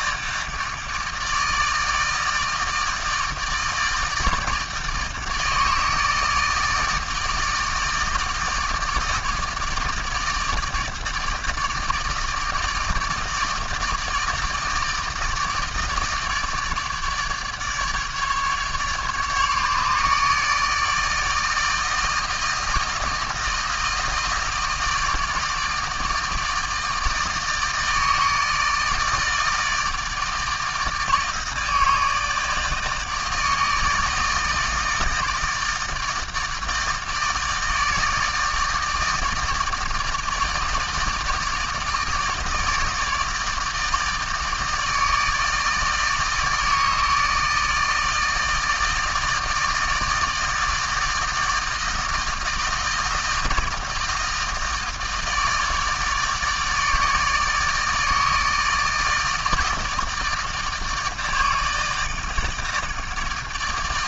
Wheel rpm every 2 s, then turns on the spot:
160, 160, 160, 160, 160, 160, 160, 160, 150, 150, 150, 160, 160, 160, 160, 160, 160, 160, 160, 160, 160, 160, 160, 160, 160, 160, 160, 160, 150, 160, 160, 160.
none